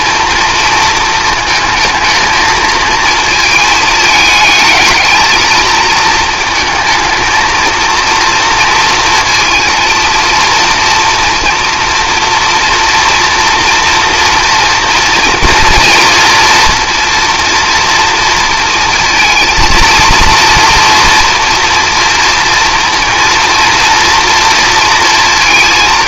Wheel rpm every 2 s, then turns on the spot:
230, 220, 220, 220, 230, 230, 230, 230, 230, 230, 230, 230, 230.
none